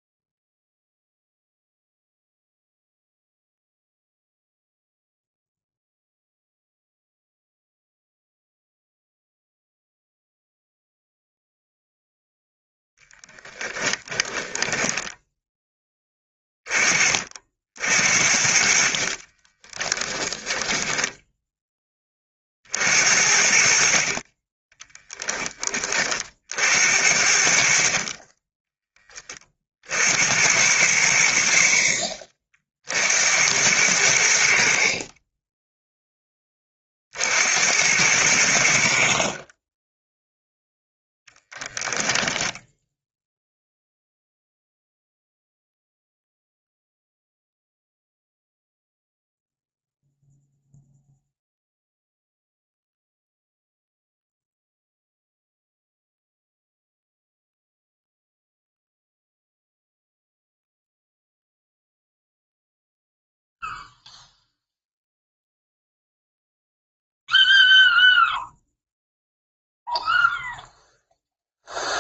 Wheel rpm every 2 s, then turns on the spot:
0, 0, 0, 0, 0, 0, 10, 20, 30, 50, 10, 60, 10, 70, 20, 100, 70, 60, 40, 60, 0, 0, 0, 0, 0, 0, 0, 0, 0, 0, 0, 0, 0, 0, 0, 0.
14-16 20-22 24-26